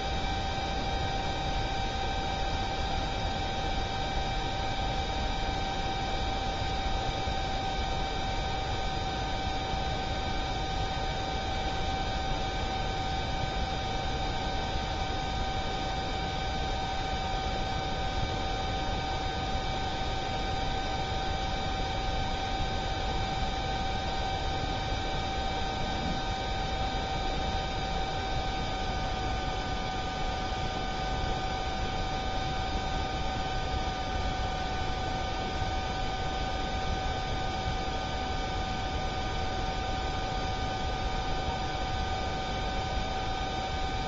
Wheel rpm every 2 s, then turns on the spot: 0, 0, 0, 0, 0, 0, 0, 0, 0, 0, 0, 0, 0, 0, 0, 0, 0, 0, 0, 0, 0, 0.
none